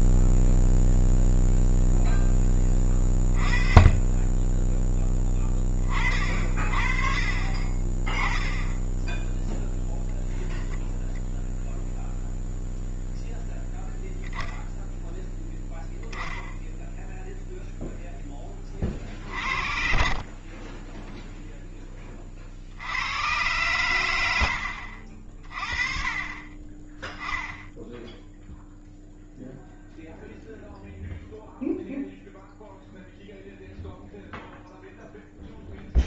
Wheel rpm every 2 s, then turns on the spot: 0, 20, 10, 40, 10, 0, 0, 0, 0, 30, 10, 80, 60, 20, 0, 0, 0, 0.
18-22